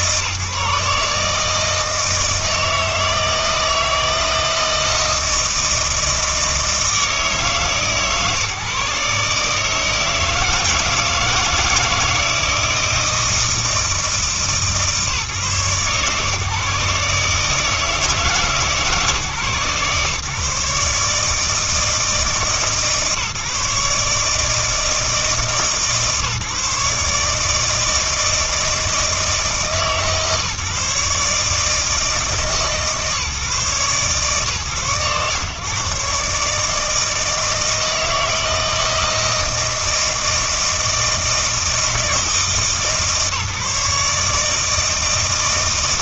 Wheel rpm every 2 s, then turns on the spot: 150, 160, 160, 160, 140, 160, 160, 150, 150, 140, 150, 150, 160, 150, 160, 150, 150, 130, 150, 160, 160, 160, 160.
none